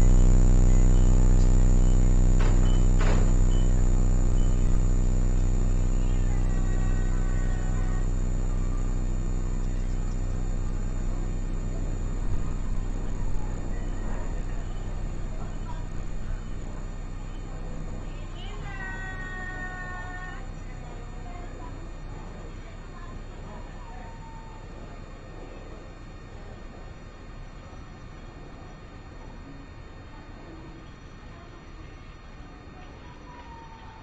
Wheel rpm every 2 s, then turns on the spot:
0, 0, 0, 0, 0, 0, 0, 0, 0, 0, 0, 0, 0, 0, 0, 0, 0.
none